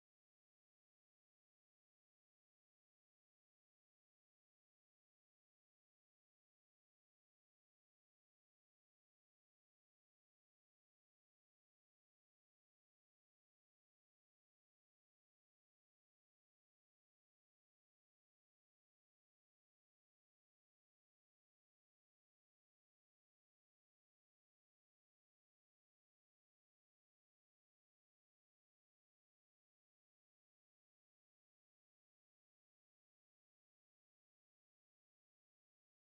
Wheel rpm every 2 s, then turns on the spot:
0, 0, 0, 0, 0, 0, 0, 0, 0, 0, 0, 0, 0, 0, 0, 0, 0, 0.
none